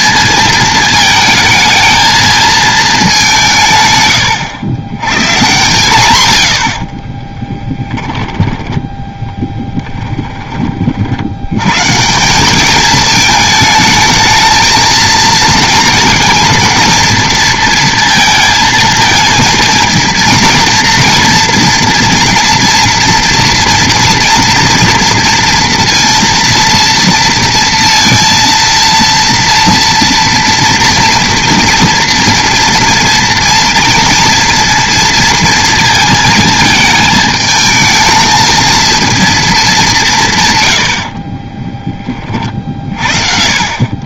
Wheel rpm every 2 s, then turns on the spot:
220, 220, 110, 60, 10, 30, 210, 220, 230, 230, 230, 230, 230, 230, 230, 230, 230, 230, 220, 220, 90, 40.
none